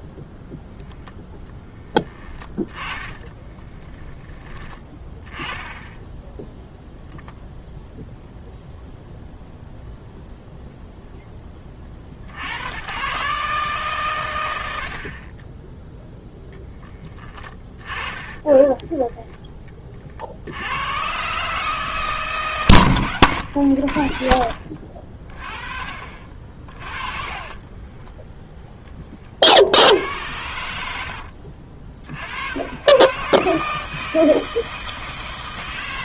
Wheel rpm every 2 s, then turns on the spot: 0, 30, 20, 0, 0, 0, 110, 60, 20, 10, 120, 120, 50, 40, 20, 70, 110, 160.
2-4 18-20 26-28